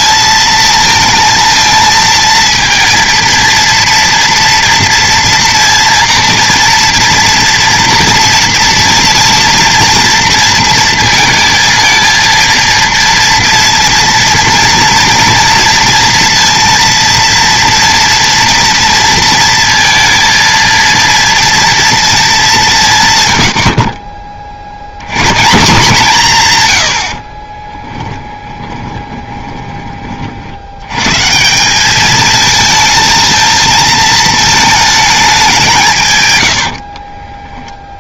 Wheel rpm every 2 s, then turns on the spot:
230, 230, 230, 230, 230, 230, 230, 230, 230, 230, 230, 170, 60, 120, 20, 80, 220, 220, 80.
28-30 36-38